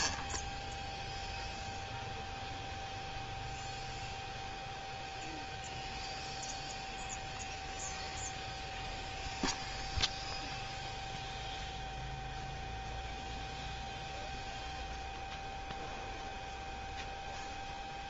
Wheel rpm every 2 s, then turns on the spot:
0, 0, 0, 0, 0, 0, 0, 0, 0.
none